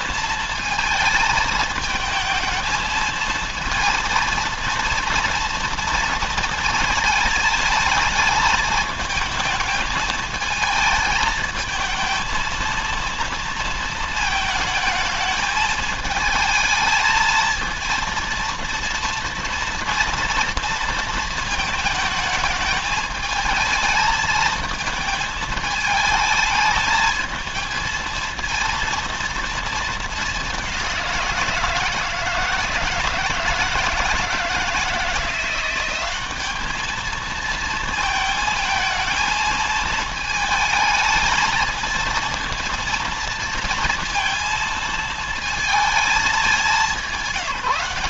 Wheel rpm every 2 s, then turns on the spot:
220, 220, 230, 220, 220, 220, 230, 220, 220, 230, 230, 220, 220, 220, 230, 190, 160, 160, 210, 220, 220, 230, 230, 190.
none